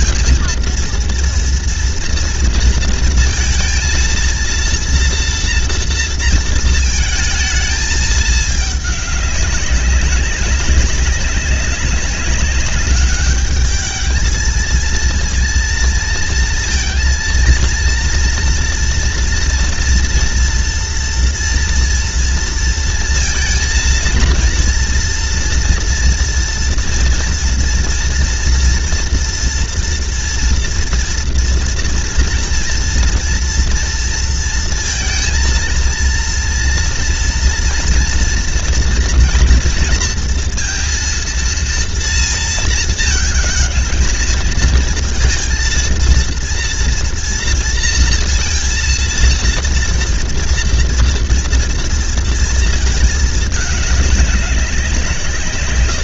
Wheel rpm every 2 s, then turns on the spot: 230, 230, 230, 230, 210, 200, 200, 220, 230, 240, 230, 230, 230, 230, 230, 230, 230, 230, 230, 230, 230, 230, 220, 230, 230, 230, 230, 210.
none